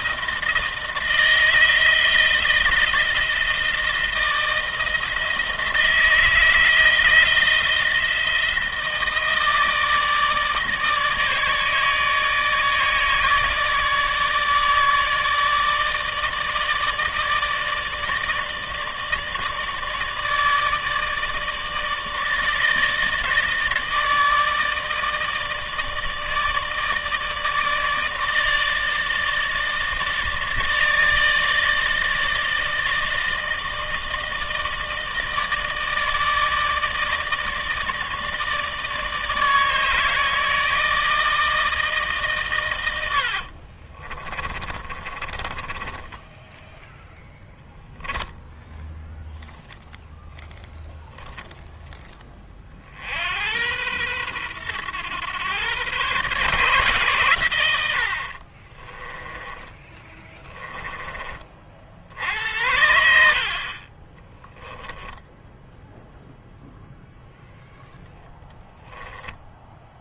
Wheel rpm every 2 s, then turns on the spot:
160, 160, 160, 160, 160, 160, 150, 160, 150, 150, 160, 160, 160, 160, 160, 150, 160, 160, 160, 160, 160, 120, 30, 10, 0, 0, 30, 110, 130, 30, 20, 70, 10, 0, 10.
44-48 58-60 64-66